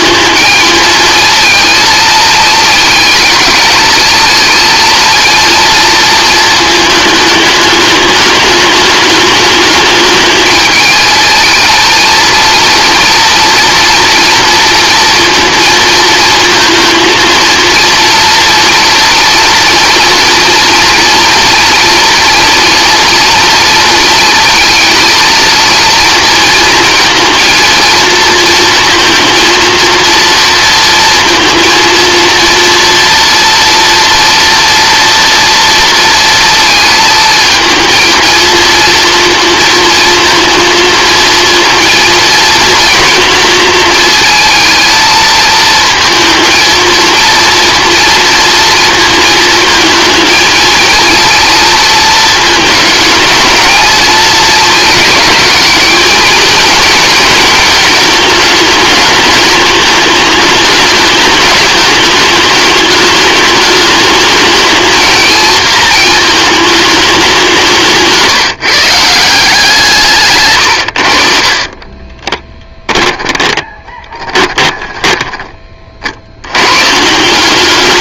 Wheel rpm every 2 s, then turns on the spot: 220, 230, 230, 220, 210, 220, 230, 230, 230, 230, 230, 230, 220, 230, 230, 230, 230, 240, 230, 230, 220, 230, 230, 230, 230, 220, 220, 220, 240, 210, 210, 210, 220, 210, 160, 110, 10, 20, 110.
70-76